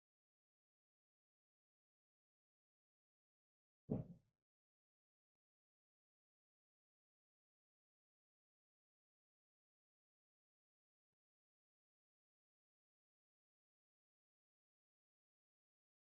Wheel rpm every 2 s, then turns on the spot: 0, 0, 0, 0, 0, 0, 0, 0.
none